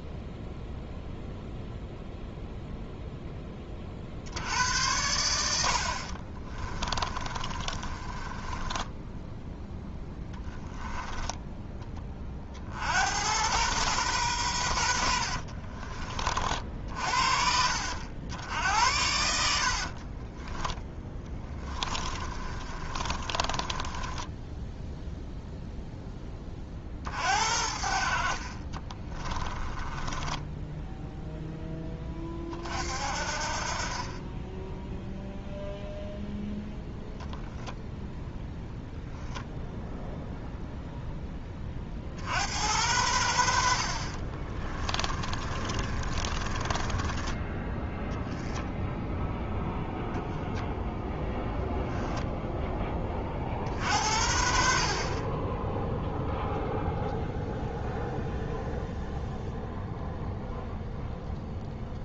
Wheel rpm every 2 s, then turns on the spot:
0, 0, 80, 20, 10, 10, 70, 110, 50, 80, 10, 30, 10, 40, 30, 10, 40, 10, 0, 0, 0, 90, 20, 20, 10, 0, 10, 50, 0, 0, 0.
6-12 20-26 28-32 44-48